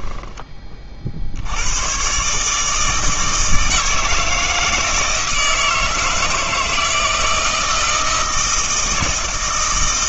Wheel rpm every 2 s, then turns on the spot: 30, 160, 160, 160, 160.
none